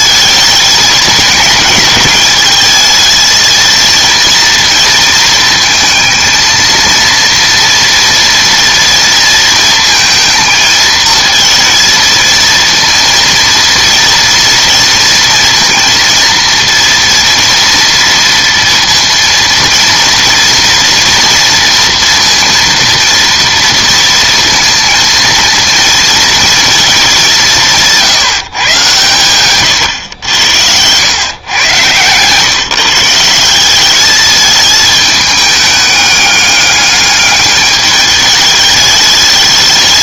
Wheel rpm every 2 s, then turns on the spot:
210, 220, 230, 230, 230, 220, 230, 230, 230, 230, 230, 230, 230, 210, 130, 100, 150, 210, 200, 210.
none